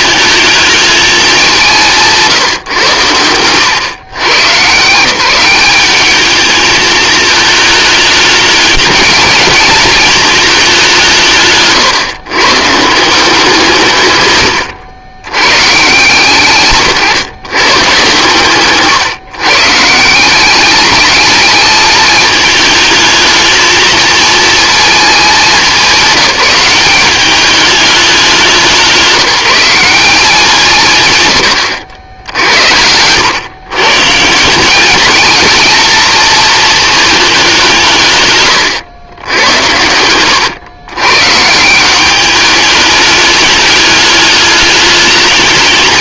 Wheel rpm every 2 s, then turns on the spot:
210, 120, 160, 220, 210, 180, 160, 70, 130, 130, 210, 220, 210, 190, 180, 130, 90, 200, 220, 110, 120, 210, 210.
none